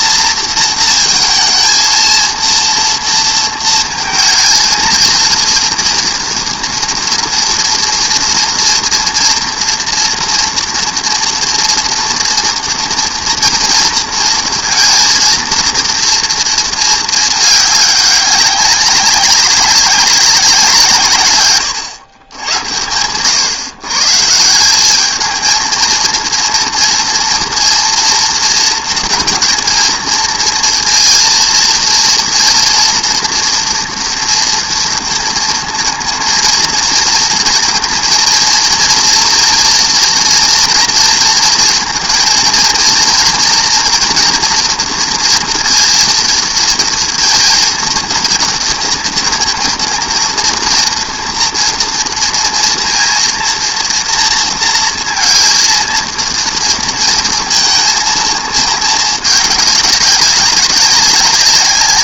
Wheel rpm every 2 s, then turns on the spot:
230, 230, 230, 230, 230, 240, 230, 230, 220, 190, 150, 110, 200, 230, 230, 230, 230, 230, 230, 230, 230, 230, 230, 230, 230, 230, 230, 230, 230, 220, 180.
none